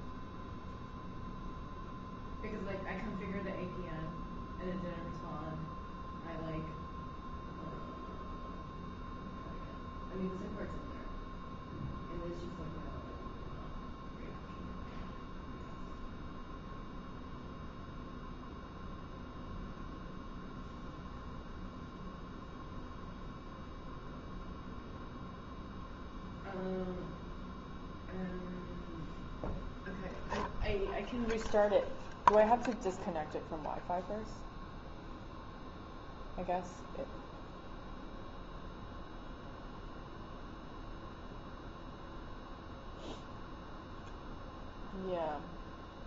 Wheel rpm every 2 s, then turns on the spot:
0, 0, 0, 0, 0, 0, 0, 0, 0, 0, 0, 0, 0, 0, 0, 0, 0, 0, 0, 0, 0, 0, 0.
none